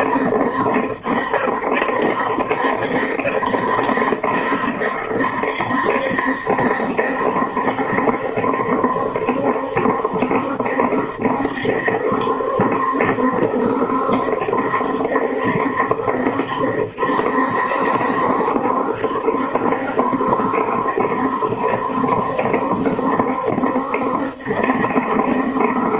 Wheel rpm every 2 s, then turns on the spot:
70, 70, 70, 70, 70, 70, 70, 70, 70, 70, 70, 70, 70.
none